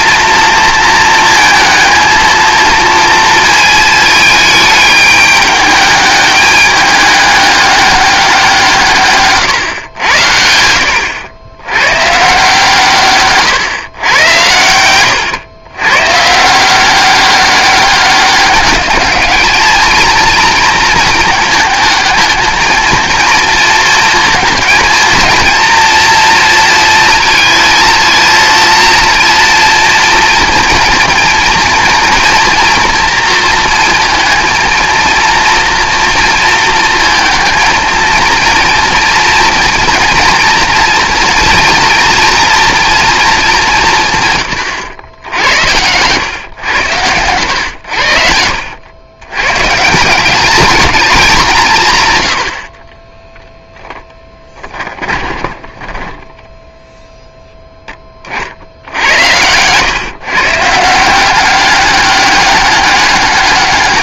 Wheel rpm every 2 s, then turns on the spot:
230, 230, 210, 210, 160, 80, 140, 90, 180, 200, 220, 230, 230, 230, 230, 230, 240, 230, 220, 230, 230, 240, 90, 110, 80, 210, 50, 20, 0, 60, 150, 200.
14-16 44-46 54-56